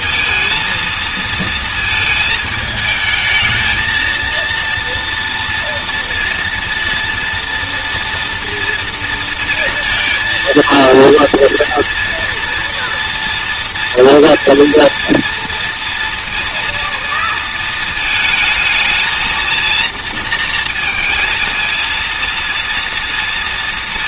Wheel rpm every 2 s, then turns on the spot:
220, 220, 230, 230, 230, 230, 240, 240, 230, 220, 230, 230.
none